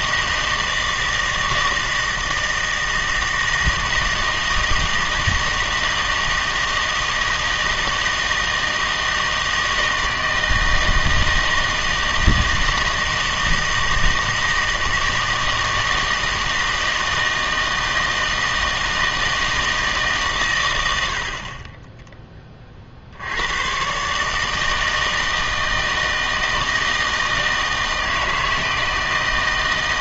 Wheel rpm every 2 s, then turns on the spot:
160, 160, 160, 160, 160, 160, 160, 160, 160, 160, 110, 40, 160, 160, 160.
none